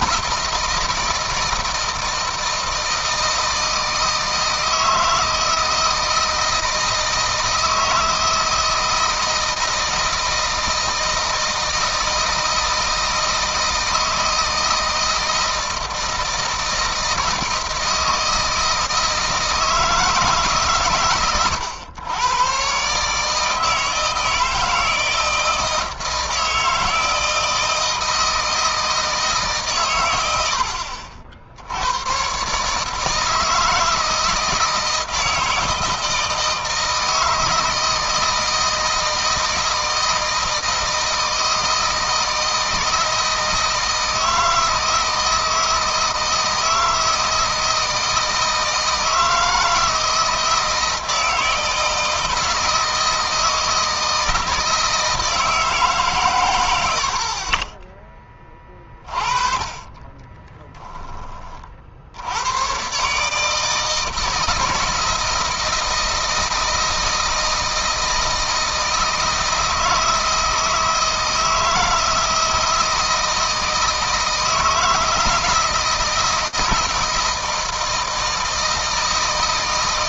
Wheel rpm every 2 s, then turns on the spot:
160, 160, 160, 160, 160, 160, 160, 160, 160, 160, 130, 140, 160, 160, 160, 60, 150, 160, 160, 160, 160, 160, 160, 160, 160, 160, 160, 160, 80, 30, 20, 120, 160, 160, 160, 160, 160, 160, 160, 160.
none